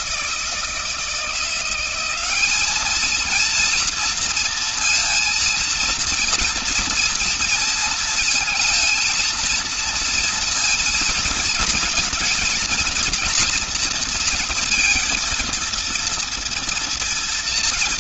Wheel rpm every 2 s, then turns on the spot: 160, 200, 230, 230, 230, 230, 230, 230, 230.
none